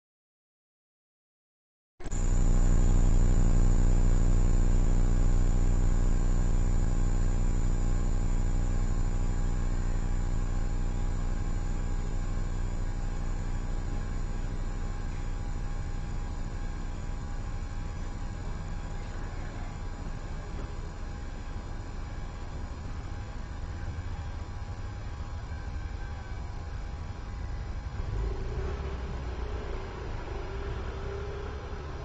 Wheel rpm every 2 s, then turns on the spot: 0, 0, 0, 0, 0, 0, 0, 0, 0, 0, 0, 0, 0, 0, 0, 0.
none